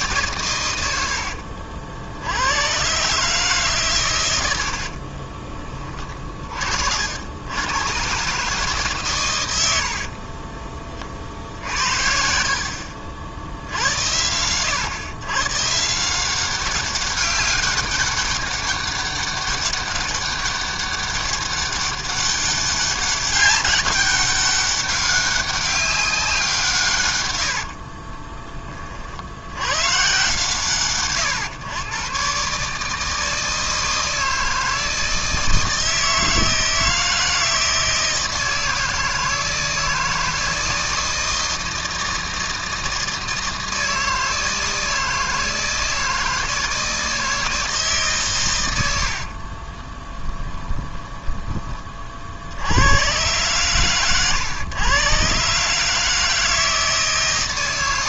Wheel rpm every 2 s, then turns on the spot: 110, 100, 70, 50, 150, 30, 60, 110, 190, 200, 200, 200, 200, 150, 30, 130, 150, 160, 160, 160, 160, 160, 160, 160, 110, 20, 90, 110, 150.
4-6 50-52